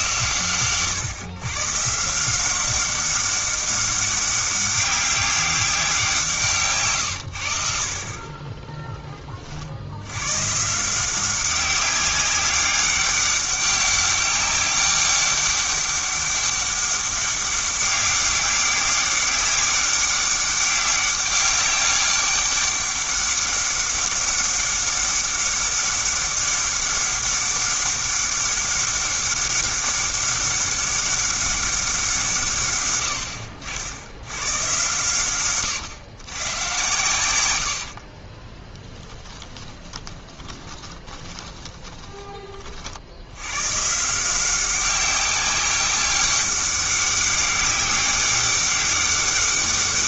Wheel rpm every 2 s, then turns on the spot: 130, 190, 200, 160, 20, 150, 200, 200, 200, 200, 200, 200, 200, 200, 200, 200, 130, 120, 110, 20, 10, 40, 180, 200, 200.
8-10 38-42